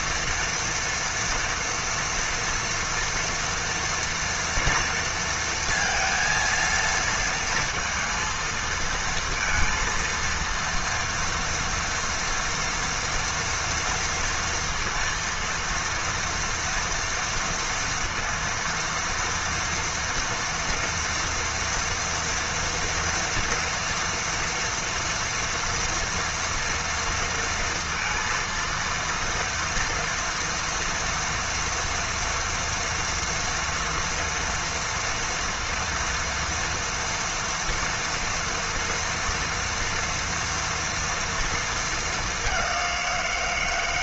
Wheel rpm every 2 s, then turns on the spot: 230, 230, 230, 230, 230, 230, 230, 230, 240, 230, 240, 230, 230, 230, 230, 230, 230, 230, 230, 230, 230, 190.
none